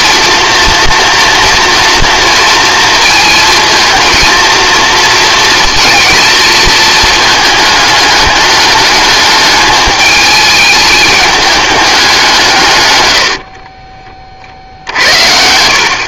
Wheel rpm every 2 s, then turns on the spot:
230, 230, 230, 230, 210, 210, 150, 60.
none